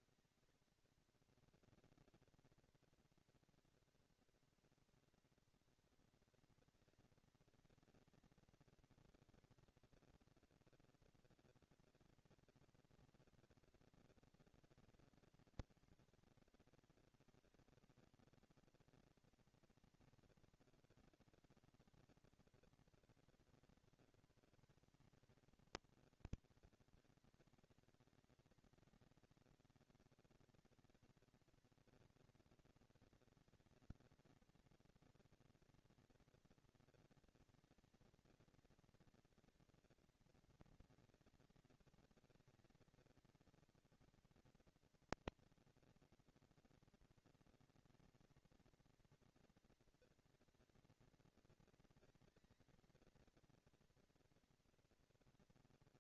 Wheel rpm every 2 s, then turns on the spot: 230, 240, 230, 230, 220, 230, 230, 230, 230, 230, 230, 230, 220, 200, 200, 210, 230, 230, 230, 230, 230, 220, 230, 230, 230, 230, 220, 230.
none